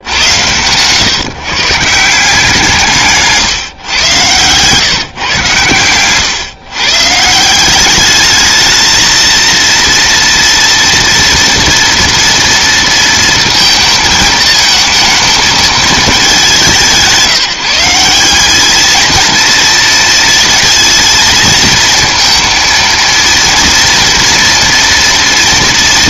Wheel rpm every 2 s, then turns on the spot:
90, 170, 120, 120, 210, 230, 230, 220, 210, 180, 230, 230, 230.
none